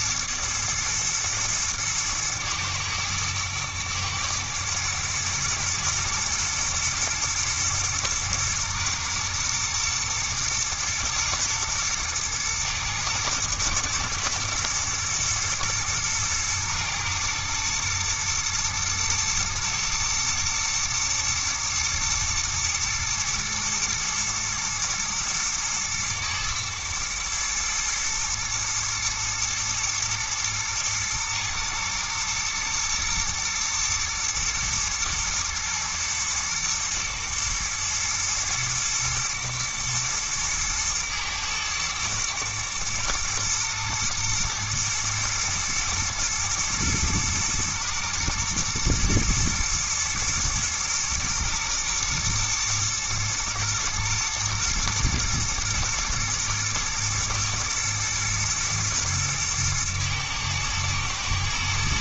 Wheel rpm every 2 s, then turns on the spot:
120, 110, 110, 120, 120, 120, 120, 120, 120, 120, 120, 120, 110, 110, 110, 110, 110, 110, 120, 110, 110, 120, 110, 110, 110, 120, 120, 110, 110, 110, 110.
none